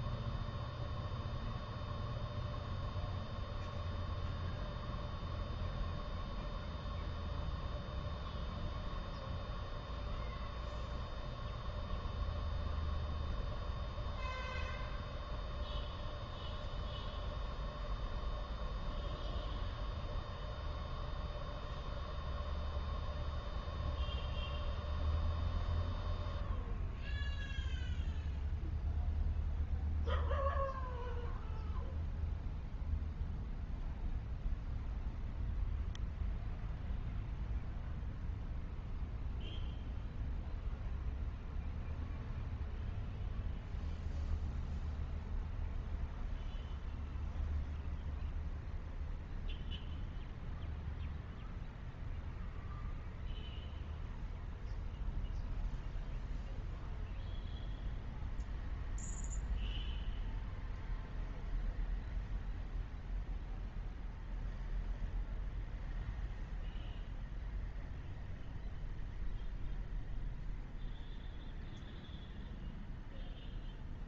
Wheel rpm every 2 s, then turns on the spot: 0, 0, 0, 0, 0, 0, 0, 0, 0, 0, 0, 0, 0, 0, 0, 0, 0, 0, 0, 0, 0, 0, 0, 0, 0, 0, 0, 0, 0, 0, 0, 0, 0, 0, 0, 0, 0.
none